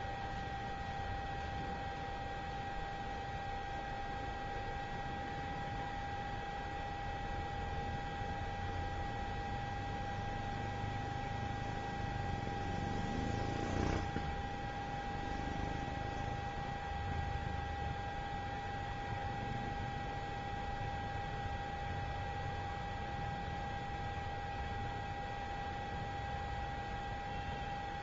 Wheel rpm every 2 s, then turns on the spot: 0, 0, 0, 0, 0, 0, 0, 0, 0, 0, 0, 0, 0, 0.
none